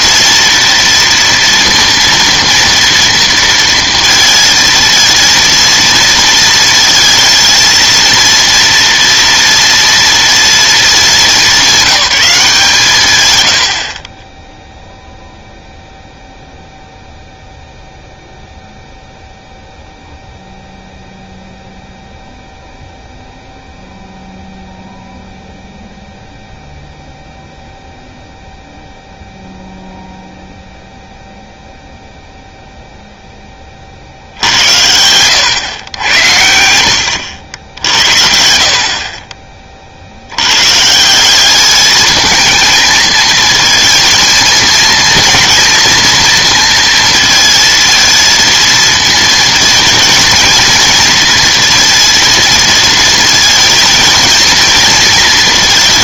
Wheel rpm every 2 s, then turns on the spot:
230, 230, 230, 230, 230, 230, 170, 0, 0, 0, 0, 0, 0, 0, 0, 0, 0, 80, 80, 50, 120, 230, 230, 230, 230, 230, 230, 230.
34-36